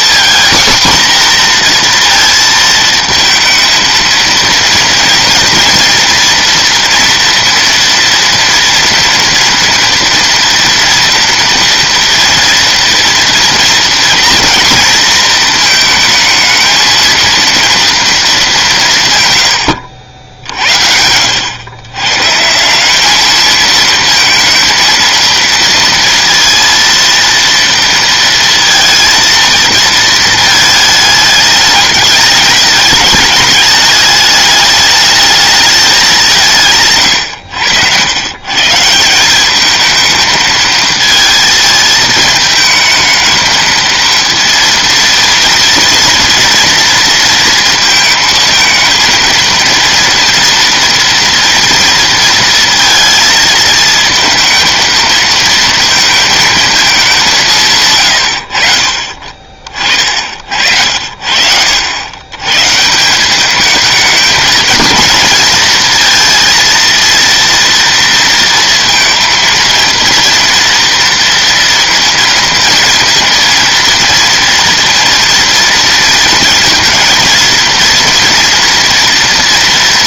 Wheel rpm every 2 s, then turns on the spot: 240, 230, 230, 230, 230, 230, 230, 230, 220, 180, 70, 190, 230, 230, 230, 220, 210, 210, 160, 160, 220, 220, 230, 230, 230, 230, 230, 220, 220, 60, 60, 140, 230, 230, 230, 230, 230, 230, 230, 230.
none